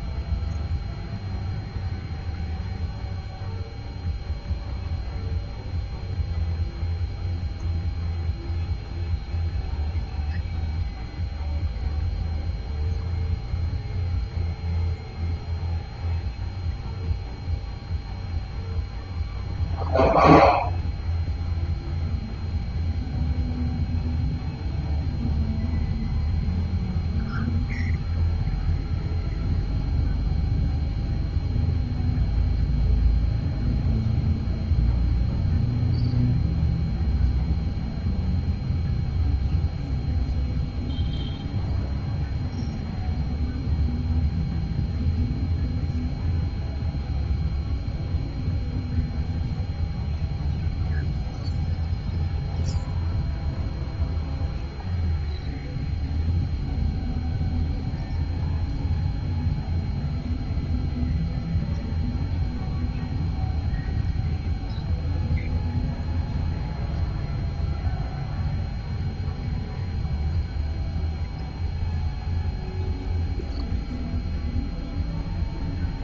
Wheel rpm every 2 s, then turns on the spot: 0, 0, 0, 0, 0, 0, 0, 0, 0, 0, 0, 0, 0, 0, 0, 0, 0, 0, 0, 0, 0, 0, 0, 0, 0, 0, 0, 0, 0, 0, 0, 0, 0, 0, 0, 0, 0, 0.
none